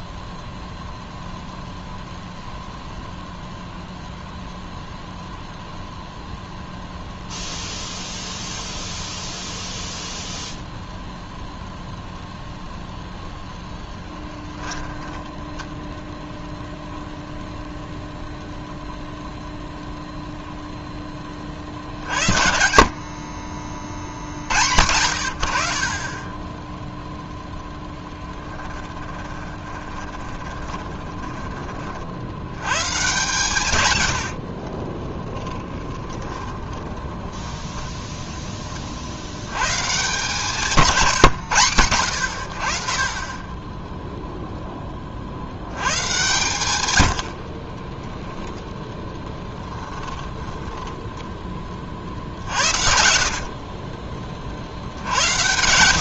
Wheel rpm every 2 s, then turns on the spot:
0, 0, 0, 0, 0, 0, 0, 10, 0, 0, 0, 60, 70, 10, 20, 20, 120, 40, 20, 40, 150, 50, 0, 110, 10, 10, 70, 50.
14-16 28-32 34-38 50-54